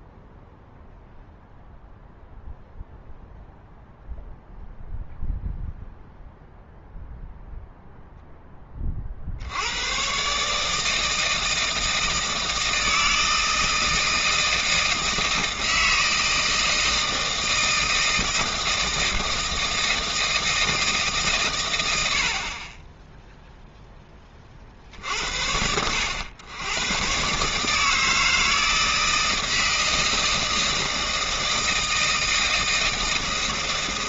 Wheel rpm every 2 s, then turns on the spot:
0, 0, 0, 0, 30, 150, 160, 160, 160, 160, 160, 30, 60, 110, 160, 160, 160.
none